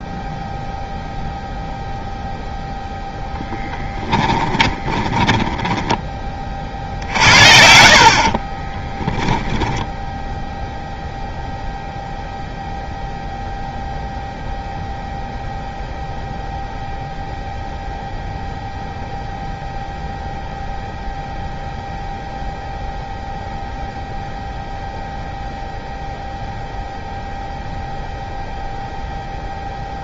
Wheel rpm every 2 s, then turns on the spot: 0, 0, 20, 50, 20, 0, 0, 0, 0, 0, 0, 0, 0, 0, 0.
4-6 8-10